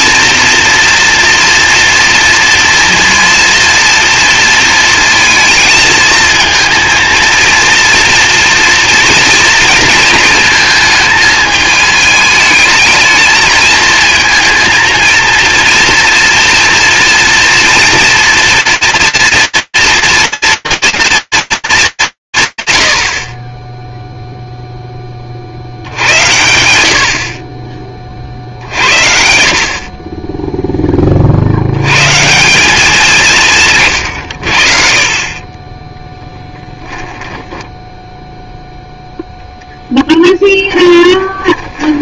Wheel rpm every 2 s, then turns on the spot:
230, 230, 230, 220, 230, 220, 220, 230, 230, 230, 230, 130, 10, 70, 50, 30, 170, 30, 10, 0, 30.
36-38 40-42